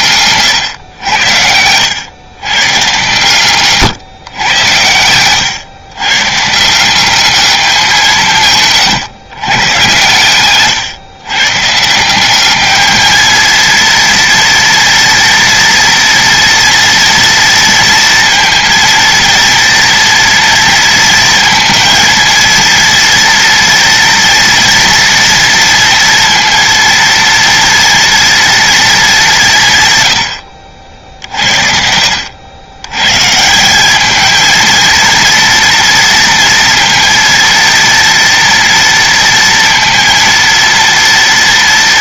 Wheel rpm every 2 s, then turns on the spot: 110, 120, 100, 170, 140, 130, 210, 230, 230, 230, 230, 230, 230, 230, 230, 70, 110, 230, 230, 230, 230.
none